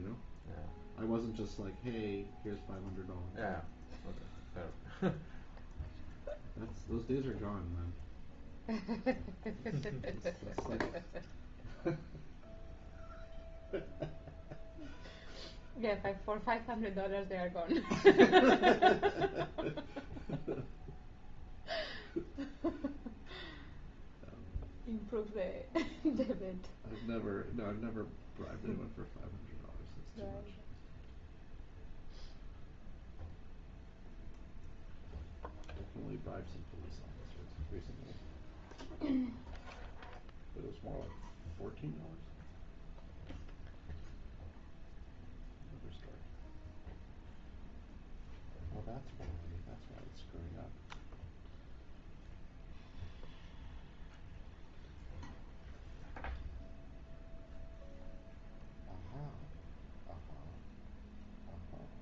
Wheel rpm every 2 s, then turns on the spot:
0, 0, 0, 0, 0, 0, 0, 0, 0, 0, 0, 0, 0, 0, 0, 0, 0, 0, 0, 0, 0, 0, 0, 0, 0, 0, 0, 0, 0, 0, 0.
none